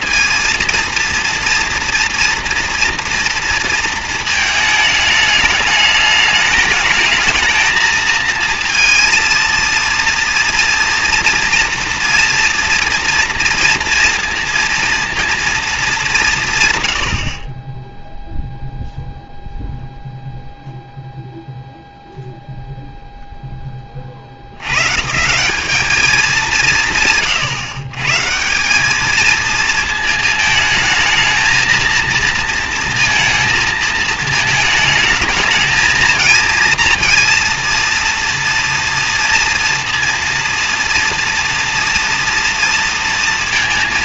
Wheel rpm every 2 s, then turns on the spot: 230, 230, 210, 220, 230, 230, 230, 230, 50, 0, 0, 0, 110, 180, 190, 220, 230, 220, 230, 230, 240, 230.
none